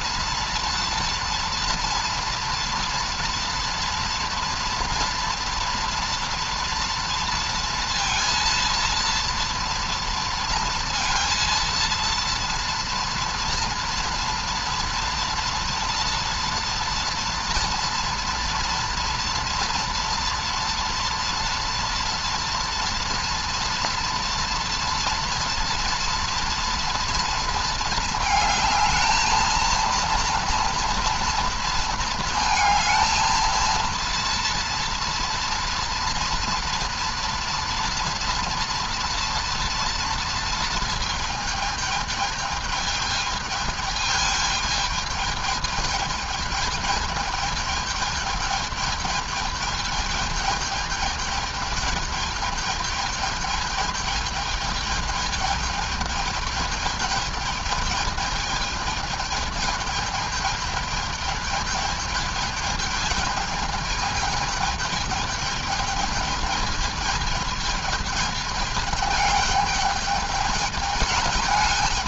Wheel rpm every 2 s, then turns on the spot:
230, 230, 230, 240, 230, 230, 230, 230, 230, 230, 230, 230, 230, 230, 220, 230, 220, 230, 230, 230, 230, 210, 210, 210, 210, 210, 210, 220, 210, 220, 210, 220, 220, 210, 210, 210.
none